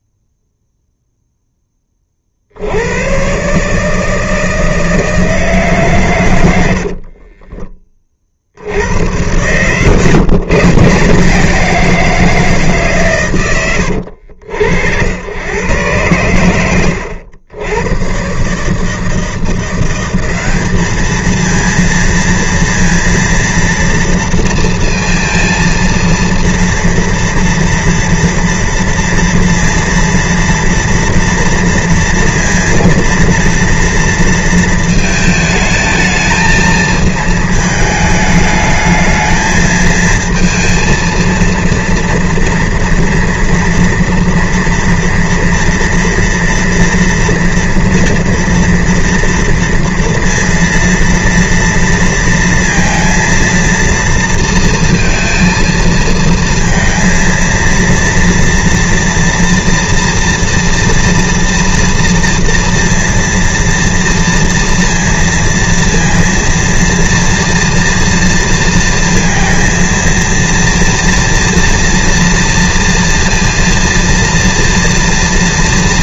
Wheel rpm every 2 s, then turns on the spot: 0, 50, 160, 120, 40, 130, 170, 80, 100, 120, 190, 230, 230, 230, 230, 230, 230, 230, 220, 220, 230, 230, 230, 230, 230, 230, 230, 230, 230, 230, 230, 230, 230, 230, 230, 230, 230, 230.
none